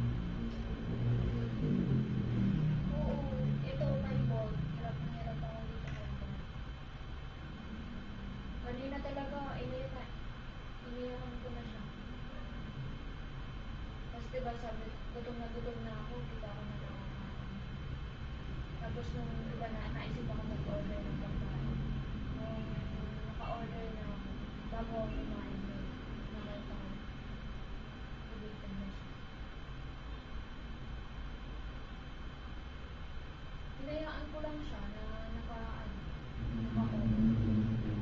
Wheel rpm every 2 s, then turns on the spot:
0, 0, 0, 0, 0, 0, 0, 0, 0, 0, 0, 0, 0, 0, 0, 0, 0, 0, 0.
none